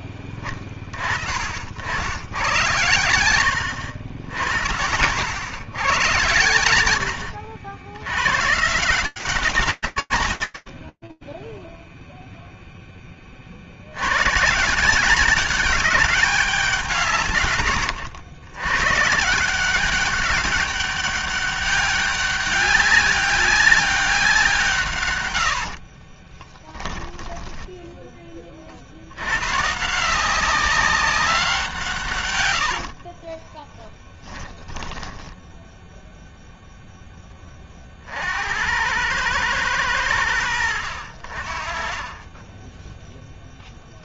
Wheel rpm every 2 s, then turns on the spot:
20, 100, 80, 90, 150, 60, 0, 140, 180, 120, 200, 200, 160, 20, 60, 190, 60, 10, 30, 110, 50, 0.
10-12 32-36